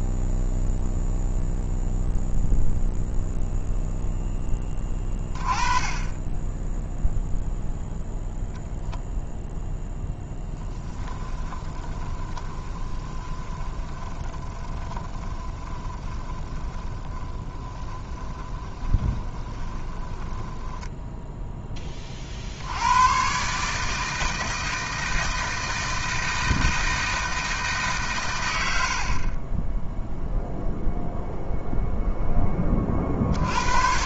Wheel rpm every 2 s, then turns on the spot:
0, 0, 20, 0, 0, 10, 20, 20, 10, 20, 10, 110, 160, 160, 50, 0, 40.
10-22